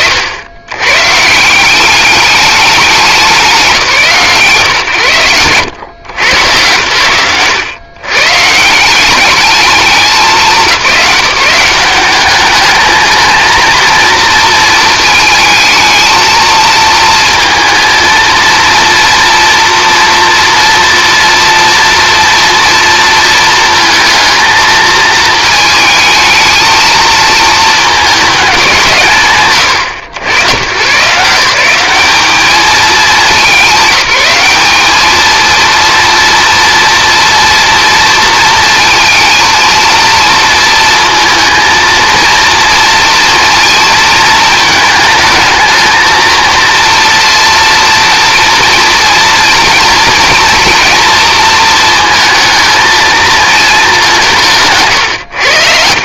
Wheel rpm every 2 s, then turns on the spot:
120, 200, 120, 110, 160, 190, 220, 220, 230, 240, 230, 230, 220, 220, 180, 140, 210, 210, 230, 220, 230, 240, 220, 230, 230, 240, 220, 150.
none